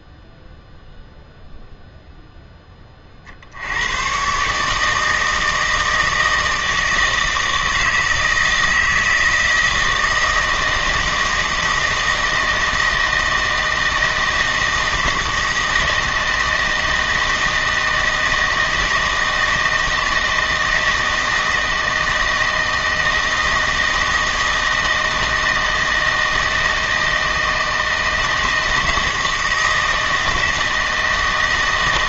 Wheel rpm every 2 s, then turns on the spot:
0, 20, 150, 160, 160, 160, 160, 160, 160, 160, 160, 160, 160, 160, 160, 160.
none